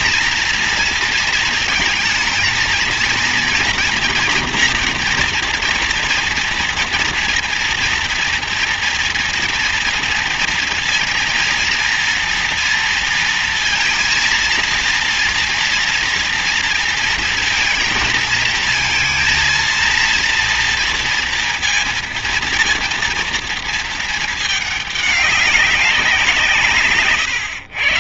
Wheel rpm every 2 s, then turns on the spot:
230, 230, 230, 230, 230, 230, 230, 230, 230, 230, 230, 230, 220, 170.
none